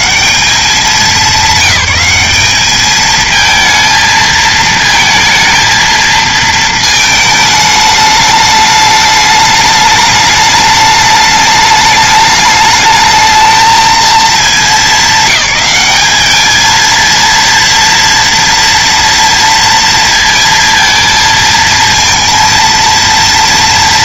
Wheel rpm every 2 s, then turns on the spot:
150, 200, 220, 220, 210, 210, 210, 220, 200, 230, 230, 230.
none